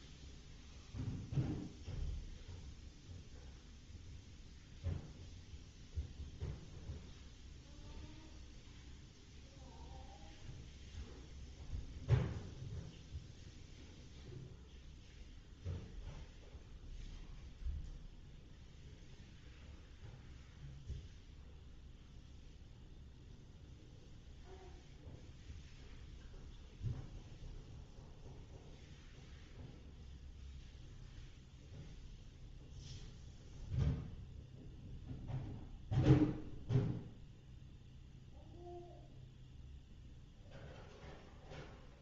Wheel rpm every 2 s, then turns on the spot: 0, 0, 0, 0, 0, 0, 0, 0, 0, 0, 0, 0, 0, 0, 0, 0, 0, 0, 0, 0, 0.
none